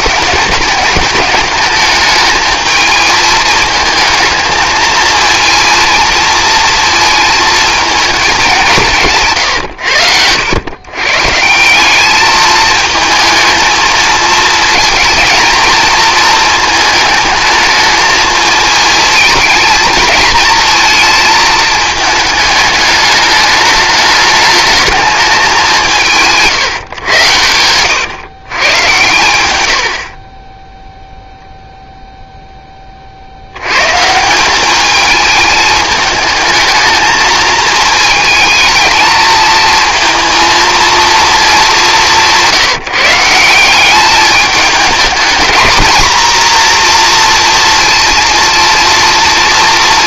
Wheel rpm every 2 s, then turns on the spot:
210, 220, 230, 230, 170, 130, 220, 230, 220, 220, 220, 210, 220, 120, 130, 0, 20, 200, 220, 220, 230, 170, 210, 230, 230.
none